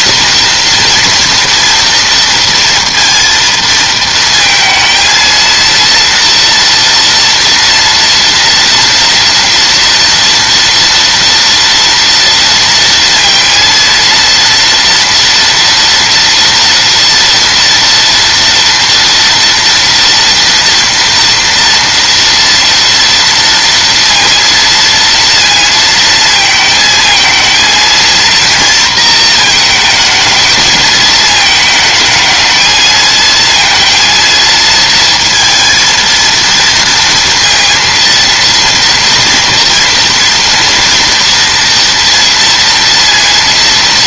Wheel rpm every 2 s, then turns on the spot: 230, 230, 220, 230, 230, 230, 230, 230, 230, 230, 230, 230, 230, 220, 230, 220, 220, 230, 230, 230, 240, 230.
none